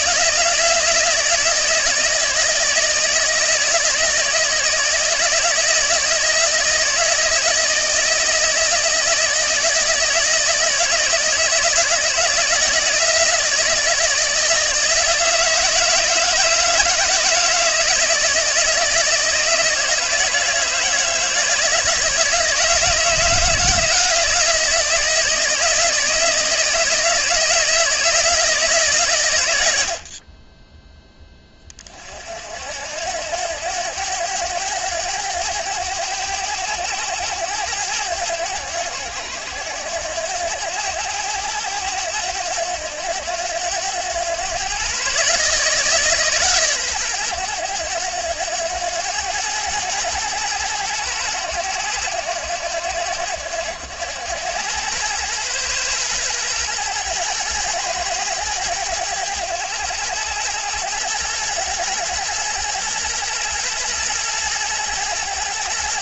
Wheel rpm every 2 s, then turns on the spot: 160, 160, 160, 160, 160, 160, 170, 160, 160, 160, 160, 160, 170, 160, 150, 20, 80, 100, 90, 90, 90, 90, 130, 120, 100, 100, 90, 110, 120, 100, 100, 110, 110.
none